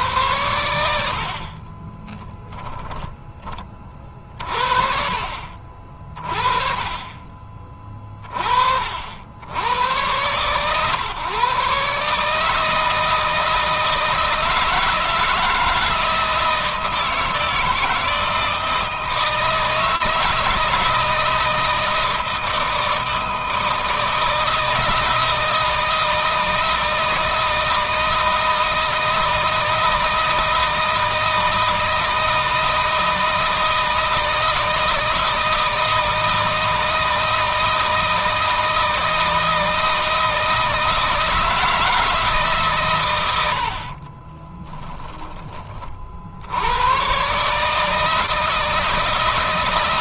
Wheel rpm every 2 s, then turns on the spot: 70, 10, 50, 20, 50, 130, 160, 160, 160, 160, 160, 160, 160, 160, 160, 160, 160, 160, 160, 160, 160, 120, 10, 110, 160.
2-4